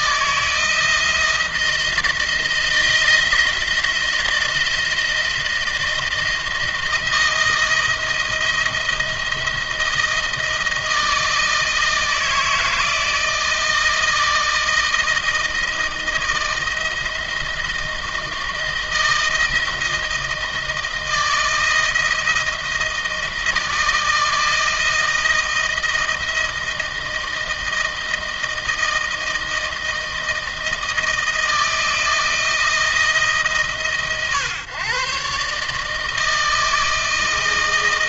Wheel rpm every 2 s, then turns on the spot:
160, 160, 160, 160, 160, 160, 160, 160, 170, 160, 160, 160, 160, 160, 160, 160, 160, 140, 160.
none